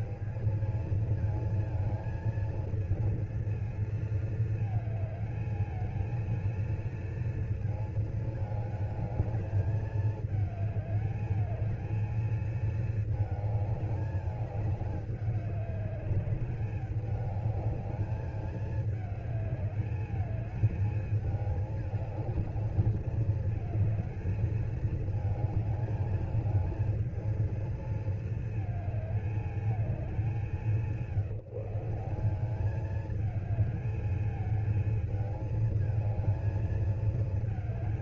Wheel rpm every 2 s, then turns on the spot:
220, 230, 220, 230, 220, 210, 220, 210, 200, 210, 210, 210, 220, 220, 220, 190, 200, 220, 220.
none